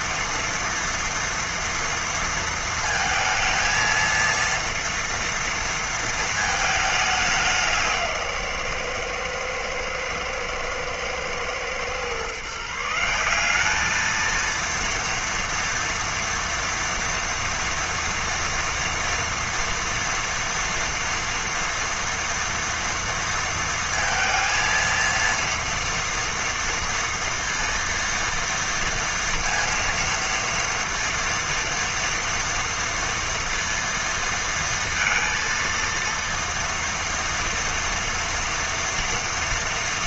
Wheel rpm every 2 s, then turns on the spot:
230, 230, 230, 210, 130, 110, 160, 230, 230, 230, 230, 230, 230, 230, 230, 230, 230, 230, 230, 240.
none